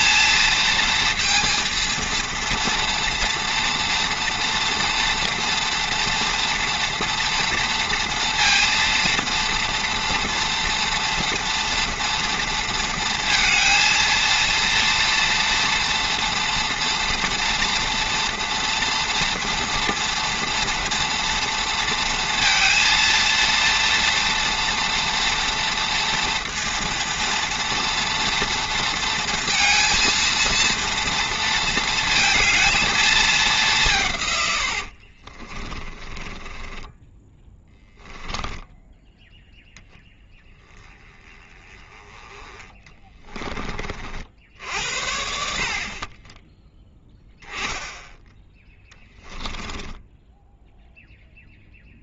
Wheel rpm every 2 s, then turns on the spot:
230, 230, 230, 230, 230, 230, 230, 230, 240, 230, 230, 230, 240, 230, 230, 230, 220, 60, 10, 10, 10, 20, 70, 10, 10, 0.
34-40 42-44 48-50